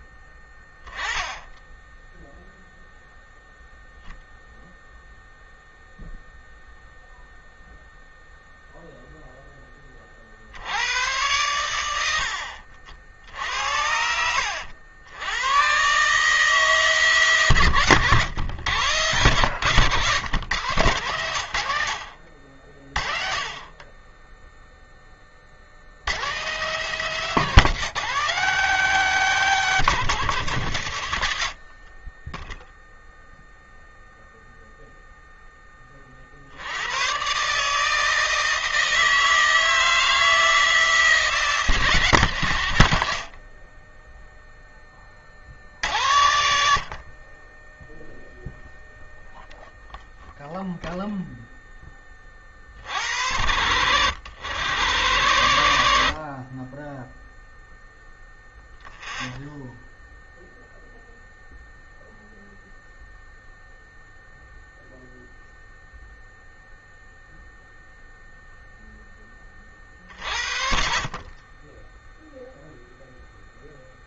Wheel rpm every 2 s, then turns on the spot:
20, 0, 0, 0, 0, 50, 70, 90, 150, 110, 110, 50, 10, 110, 160, 120, 10, 0, 50, 160, 160, 120, 10, 90, 0, 0, 40, 100, 50, 0, 0, 0, 0, 0, 0, 70, 0.
none